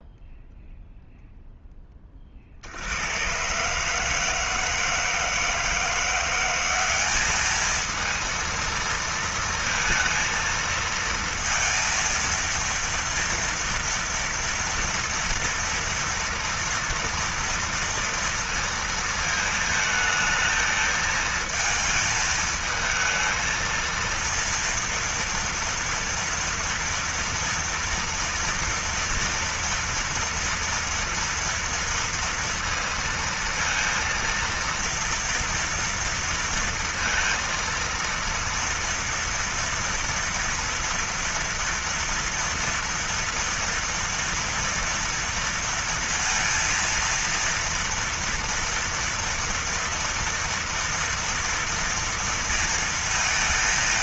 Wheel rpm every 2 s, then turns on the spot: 0, 60, 160, 180, 230, 230, 230, 230, 230, 230, 220, 220, 230, 230, 240, 230, 230, 230, 230, 230, 230, 230, 230, 230, 230, 230, 230.
none